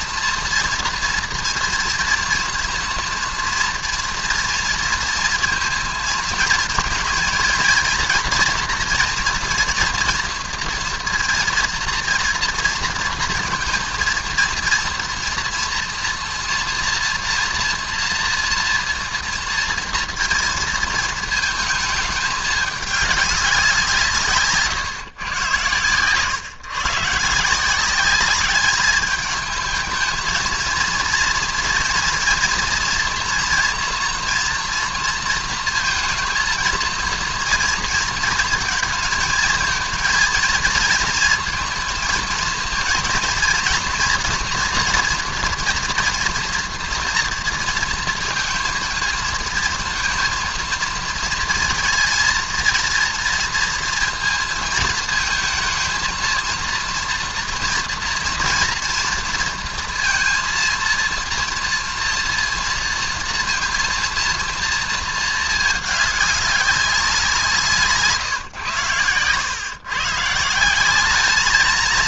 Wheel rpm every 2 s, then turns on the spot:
240, 230, 230, 230, 240, 240, 230, 230, 240, 240, 230, 210, 140, 130, 210, 230, 230, 230, 230, 220, 230, 230, 230, 230, 230, 230, 230, 230, 230, 230, 230, 230, 220, 200, 120, 190.
none